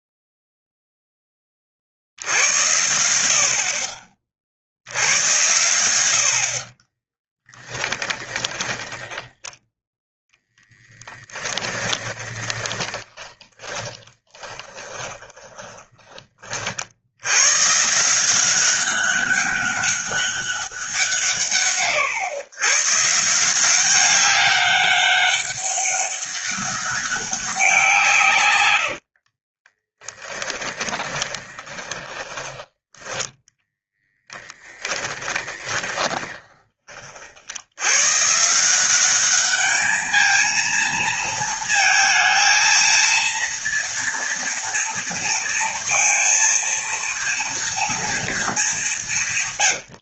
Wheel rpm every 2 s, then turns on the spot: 0, 90, 70, 30, 40, 10, 20, 20, 60, 200, 180, 140, 200, 200, 70, 20, 20, 10, 30, 180, 220, 230, 230, 230, 190.
6-10 12-16 28-32 34-36